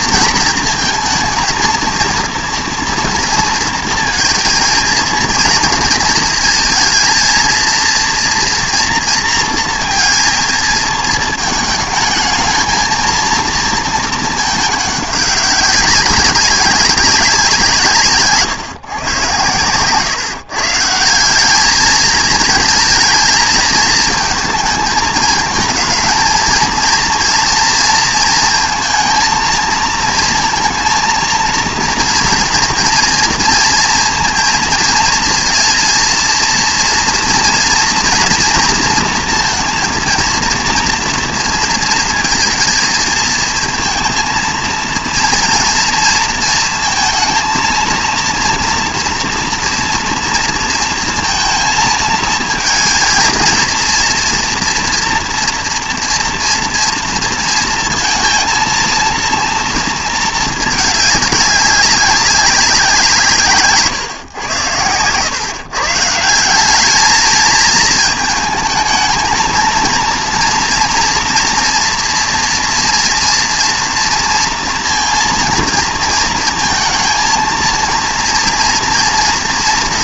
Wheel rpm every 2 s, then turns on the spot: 230, 230, 230, 220, 230, 230, 220, 210, 200, 140, 150, 230, 220, 230, 230, 230, 230, 230, 240, 240, 230, 220, 230, 230, 230, 230, 230, 240, 230, 230, 220, 180, 100, 190, 220, 230, 230, 230, 230, 230.
none